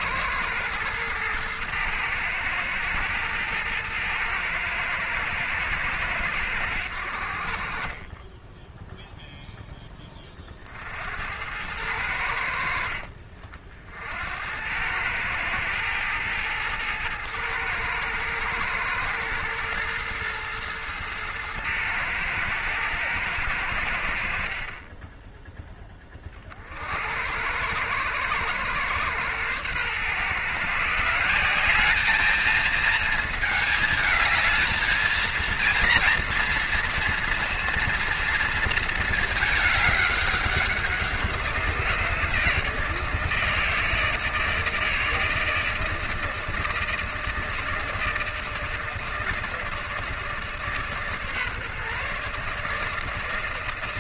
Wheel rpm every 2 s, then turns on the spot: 110, 110, 110, 80, 0, 60, 60, 100, 110, 110, 110, 110, 20, 60, 120, 160, 220, 220, 230, 230, 180, 160, 160, 160, 160, 150, 160.
none